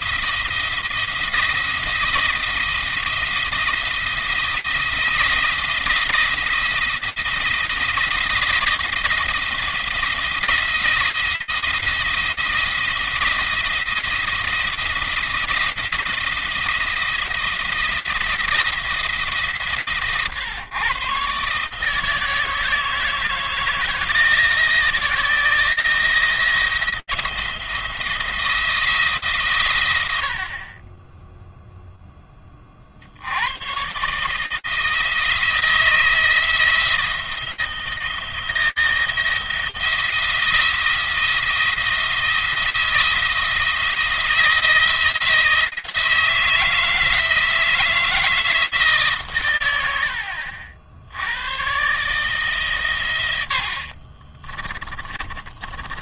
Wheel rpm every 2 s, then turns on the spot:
170, 170, 170, 170, 170, 170, 160, 170, 170, 160, 120, 160, 170, 170, 160, 20, 50, 160, 170, 170, 170, 170, 160, 160, 150, 80, 130, 30.
54-56